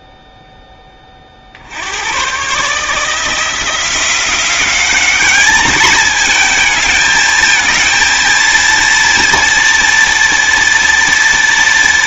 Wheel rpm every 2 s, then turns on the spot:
20, 150, 190, 220, 230, 230.
none